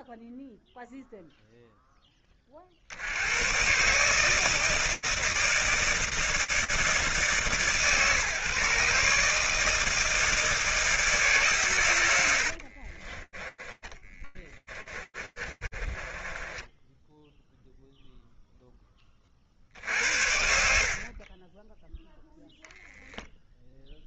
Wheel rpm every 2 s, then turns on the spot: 0, 30, 160, 160, 140, 160, 30, 20, 20, 10, 60, 0.
12-18